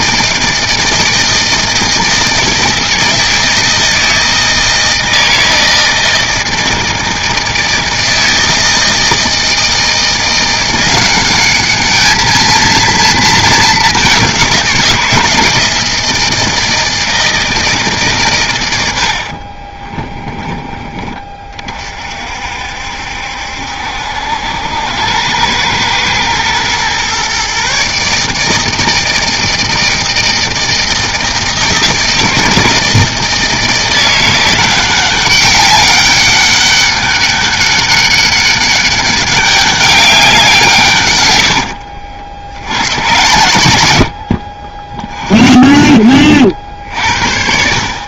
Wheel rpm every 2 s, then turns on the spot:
160, 160, 160, 160, 160, 180, 220, 180, 160, 100, 10, 60, 90, 120, 160, 160, 160, 180, 200, 200, 160, 70, 40, 60.
none